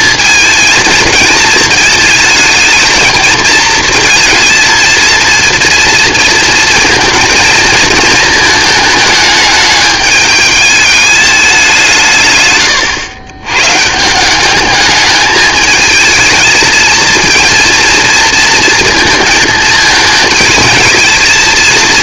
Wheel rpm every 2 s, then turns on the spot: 230, 220, 230, 230, 220, 210, 120, 210, 220, 230, 220.
none